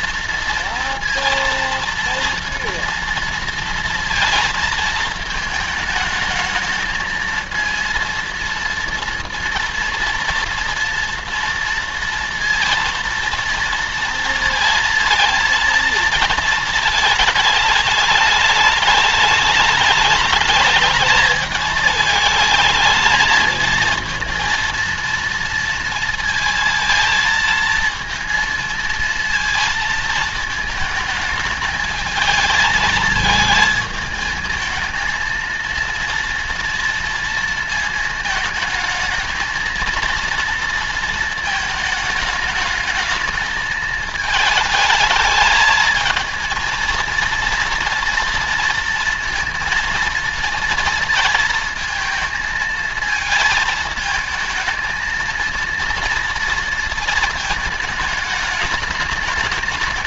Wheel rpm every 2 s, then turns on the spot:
230, 230, 230, 220, 230, 230, 230, 230, 230, 210, 210, 220, 230, 230, 230, 220, 220, 220, 230, 220, 230, 220, 220, 230, 230, 230, 220, 220, 230, 210.
none